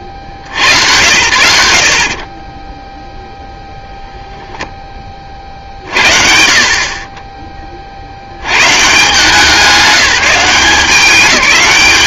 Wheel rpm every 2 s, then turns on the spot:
70, 20, 10, 50, 130, 190.
none